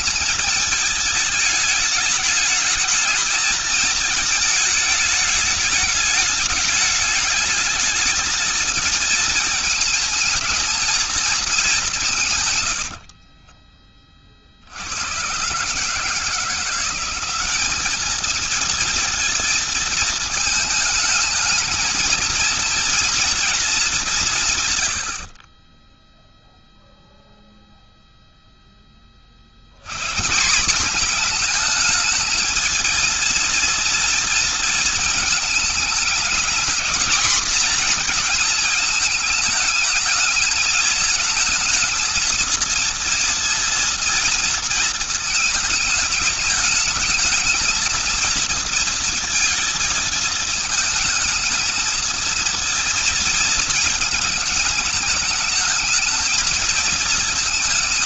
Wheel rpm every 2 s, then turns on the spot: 220, 210, 210, 210, 220, 220, 130, 60, 160, 220, 220, 230, 150, 0, 0, 170, 220, 230, 220, 230, 220, 230, 230, 210, 230, 220, 230, 210, 220.
12-14